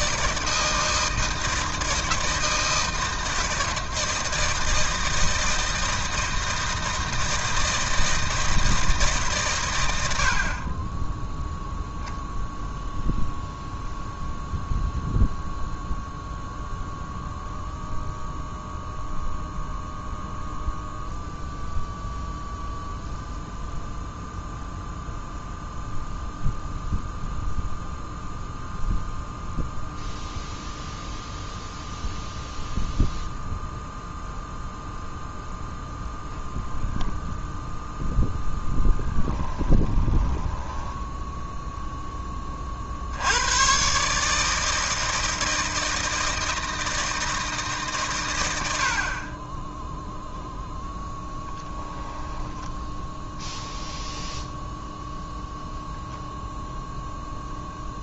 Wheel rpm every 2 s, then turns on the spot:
160, 160, 160, 160, 160, 20, 0, 0, 0, 0, 0, 0, 0, 0, 0, 0, 0, 0, 0, 20, 10, 60, 160, 160, 60, 0, 10, 0, 0.
38-42